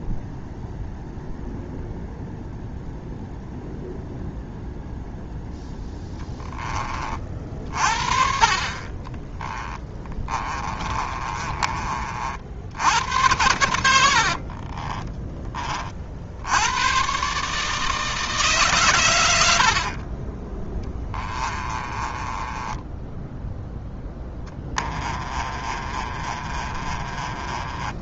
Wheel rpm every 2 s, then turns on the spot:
0, 0, 0, 20, 30, 30, 80, 30, 100, 130, 20, 10, 20, 30.
8-12 14-16 20-28